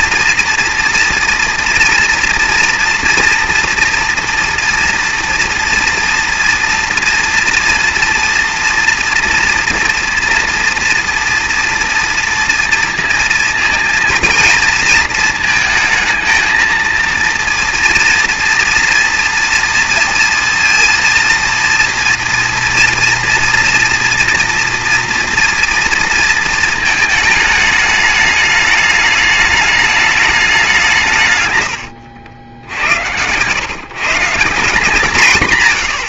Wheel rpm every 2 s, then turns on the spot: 230, 230, 230, 230, 230, 230, 230, 230, 220, 230, 230, 230, 230, 220, 210, 190, 80, 170.
none